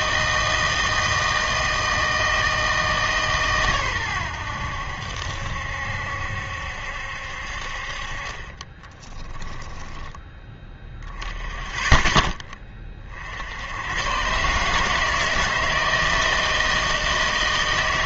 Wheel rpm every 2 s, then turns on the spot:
160, 160, 90, 70, 30, 10, 20, 140, 160.
8-10